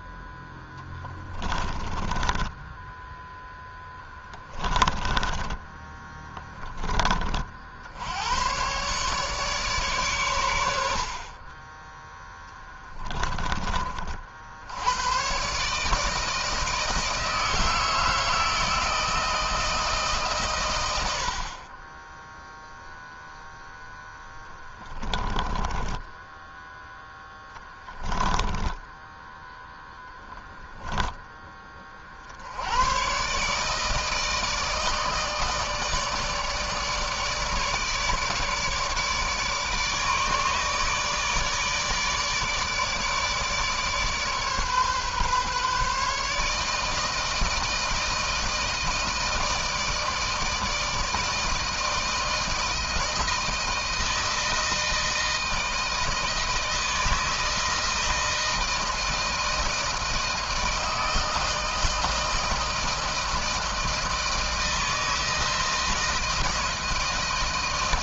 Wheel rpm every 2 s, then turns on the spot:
10, 10, 20, 20, 120, 70, 20, 80, 160, 160, 110, 0, 20, 10, 10, 10, 100, 160, 150, 150, 150, 150, 140, 150, 160, 160, 160, 160, 160, 160, 160, 160, 160, 160.
0-6 10-14 24-32